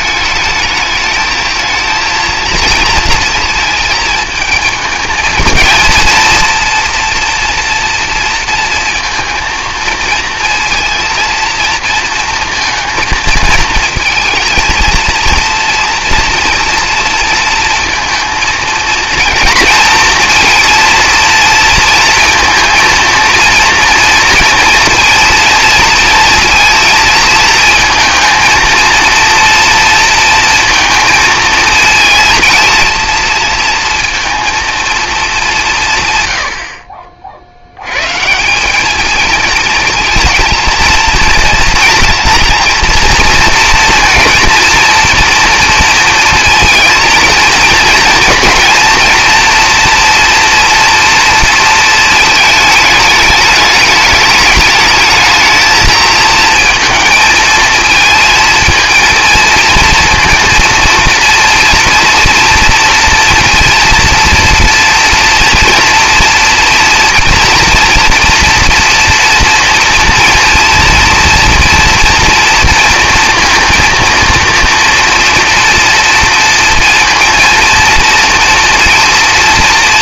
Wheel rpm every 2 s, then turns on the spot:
220, 230, 220, 230, 230, 230, 230, 230, 230, 230, 230, 230, 230, 230, 230, 230, 230, 230, 50, 190, 230, 230, 230, 230, 240, 230, 210, 210, 230, 230, 230, 230, 230, 230, 230, 230, 230, 230, 230, 230.
none